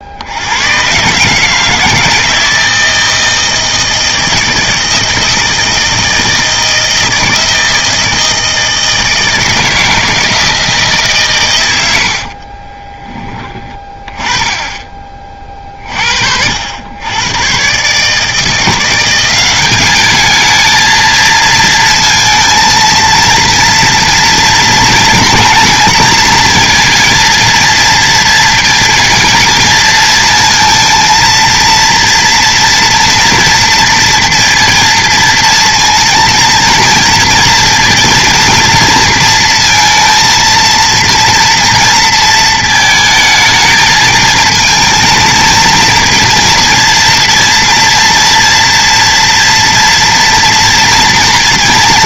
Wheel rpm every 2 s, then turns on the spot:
110, 160, 160, 160, 160, 160, 30, 30, 90, 170, 220, 230, 230, 230, 230, 230, 230, 230, 230, 230, 230, 220, 220, 230, 230, 230.
12-14